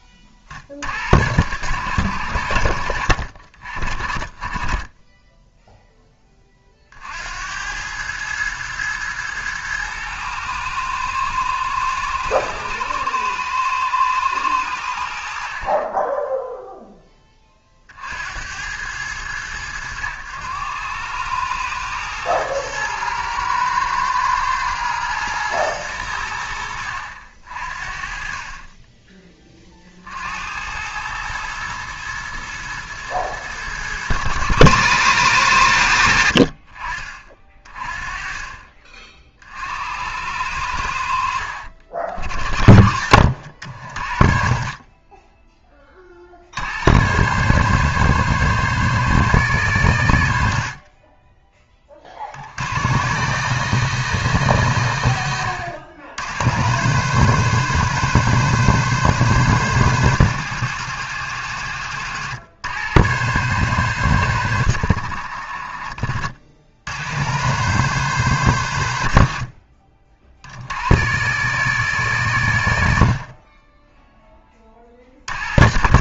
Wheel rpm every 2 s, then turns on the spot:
70, 70, 20, 40, 110, 110, 110, 80, 0, 90, 100, 110, 110, 80, 30, 90, 110, 100, 40, 40, 80, 60, 20, 80, 140, 50, 80, 100, 110, 130, 110, 100, 100, 80, 100, 80, 80, 30.
42-44